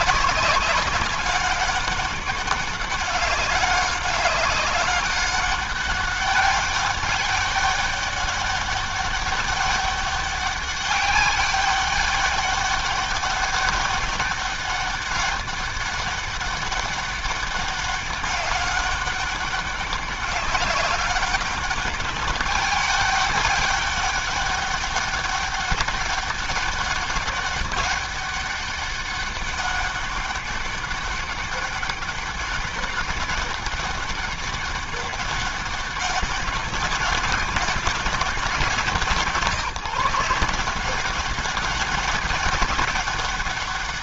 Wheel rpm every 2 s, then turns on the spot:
200, 200, 200, 200, 200, 200, 200, 200, 200, 200, 190, 200, 200, 200, 200, 200, 200, 200, 200, 180, 170, 190.
none